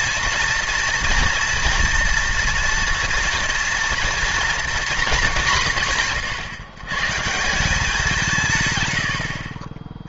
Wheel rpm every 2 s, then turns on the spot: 230, 230, 240, 130, 140.
none